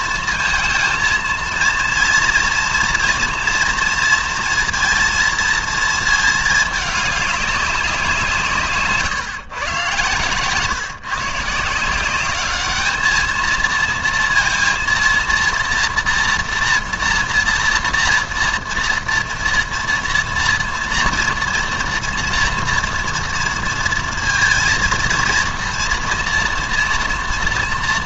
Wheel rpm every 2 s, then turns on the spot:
230, 240, 230, 210, 140, 130, 210, 230, 230, 230, 230, 240, 230, 230.
8-10